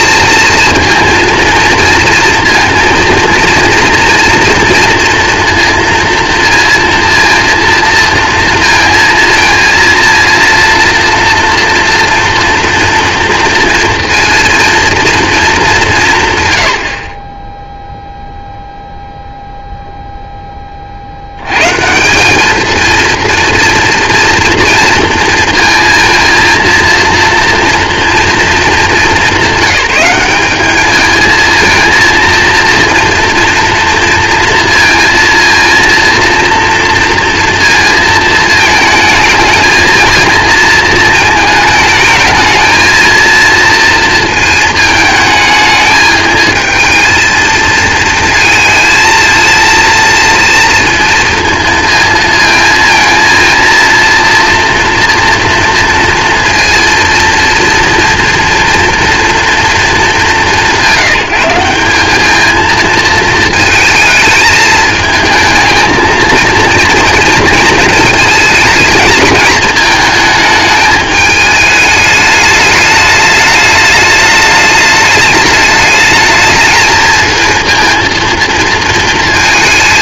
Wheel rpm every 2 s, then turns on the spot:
230, 230, 230, 230, 230, 230, 230, 230, 110, 0, 30, 220, 230, 230, 220, 210, 230, 230, 230, 220, 220, 220, 220, 220, 230, 230, 230, 230, 230, 230, 200, 220, 220, 230, 220, 210, 210, 210, 220, 230.
none